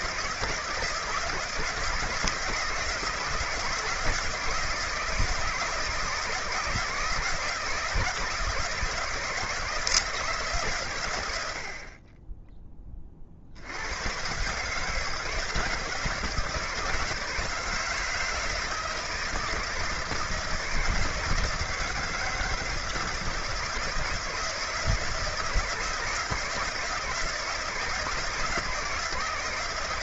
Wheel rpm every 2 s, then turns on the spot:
160, 160, 160, 160, 160, 130, 20, 150, 160, 160, 160, 160, 150, 160, 160.
none